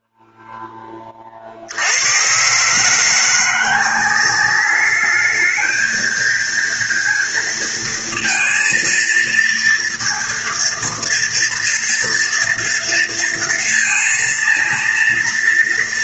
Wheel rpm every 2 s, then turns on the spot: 30, 170, 210, 230, 230, 230, 230, 230.
none